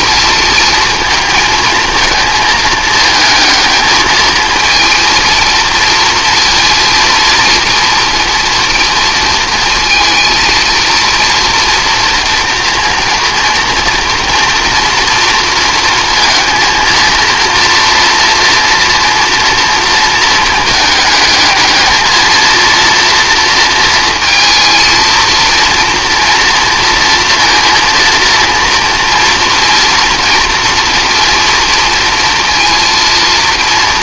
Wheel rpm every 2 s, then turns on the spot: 230, 220, 230, 230, 230, 230, 230, 230, 230, 230, 220, 230, 230, 230, 230, 240, 230.
none